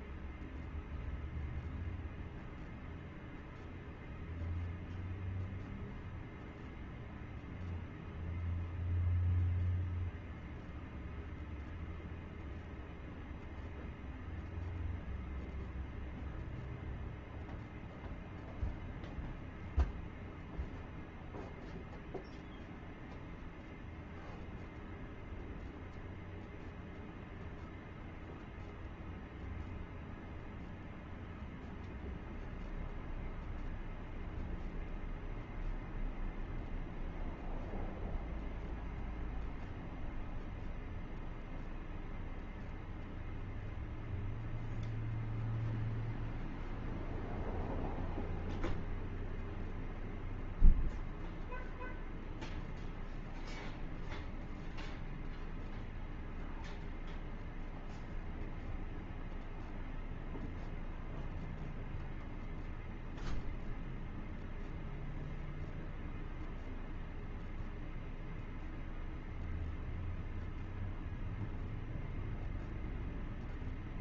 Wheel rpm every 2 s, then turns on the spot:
0, 0, 0, 0, 0, 0, 0, 0, 0, 0, 0, 0, 0, 0, 0, 0, 0, 0, 0, 0, 0, 0, 0, 0, 0, 0, 0, 0, 0, 0, 0, 0, 0, 0, 0, 0, 0.
none